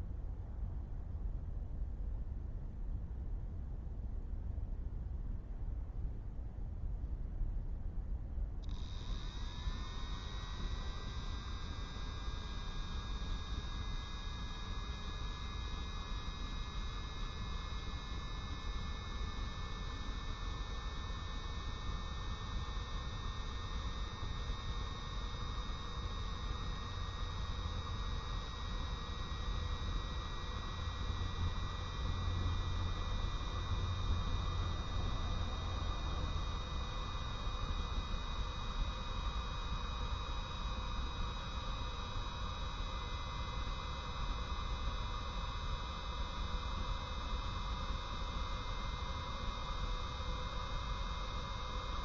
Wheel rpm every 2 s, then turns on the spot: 0, 0, 0, 0, 0, 0, 0, 0, 0, 0, 0, 0, 0, 0, 0, 0, 0, 0, 0, 0, 0, 0, 0, 0, 0, 0.
none